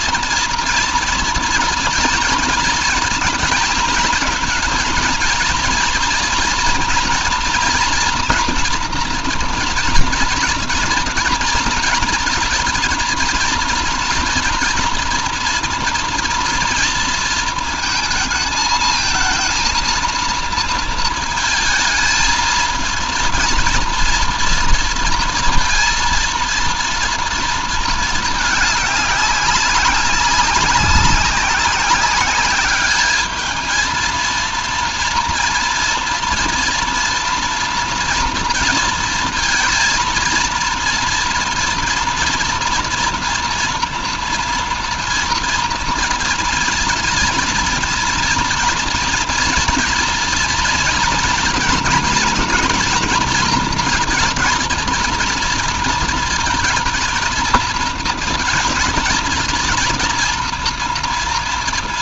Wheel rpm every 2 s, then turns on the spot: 230, 230, 230, 230, 230, 230, 230, 230, 230, 220, 230, 230, 230, 230, 210, 190, 210, 230, 230, 230, 230, 230, 230, 240, 230, 240, 230, 230, 220, 230, 230.
none